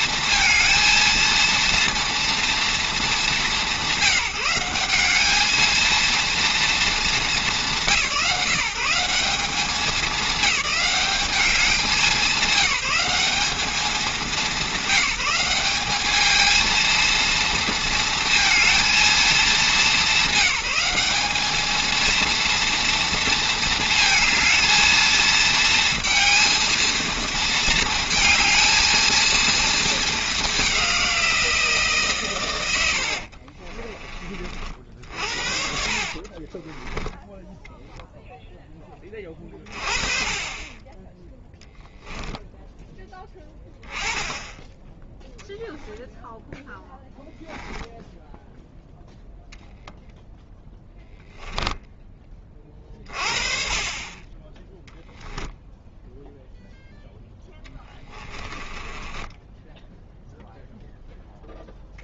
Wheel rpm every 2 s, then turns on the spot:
230, 220, 180, 230, 140, 210, 200, 180, 220, 230, 190, 230, 220, 230, 220, 190, 100, 50, 20, 10, 20, 10, 10, 0, 0, 10, 30, 10, 0, 20, 10.
36-38 58-60